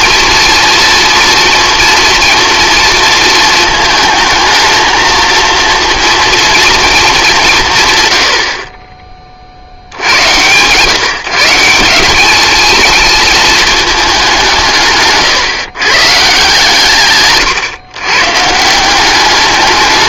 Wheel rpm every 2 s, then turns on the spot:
230, 230, 220, 230, 40, 130, 220, 170, 150, 160.
none